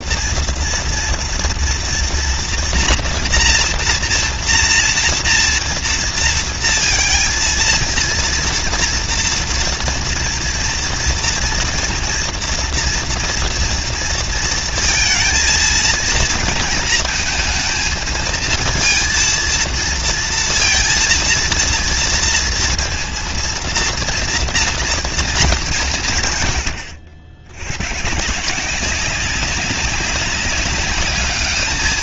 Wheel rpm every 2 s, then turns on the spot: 210, 230, 230, 230, 230, 230, 230, 230, 230, 220, 230, 230, 230, 210, 90, 190.
none